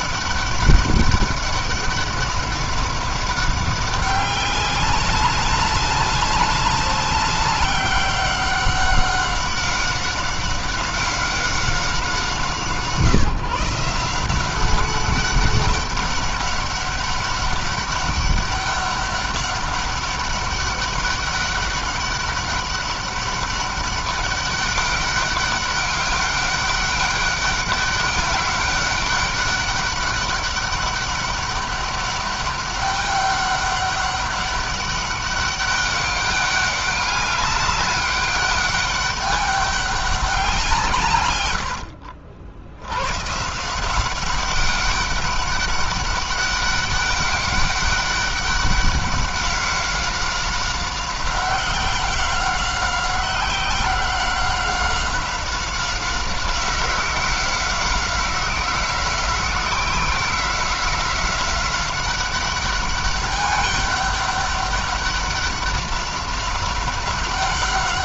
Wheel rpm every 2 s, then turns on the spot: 200, 200, 190, 200, 190, 190, 160, 190, 200, 200, 200, 200, 200, 200, 200, 200, 200, 200, 200, 200, 150, 110, 200, 200, 200, 190, 190, 190, 190, 180, 190, 200, 200, 190.
none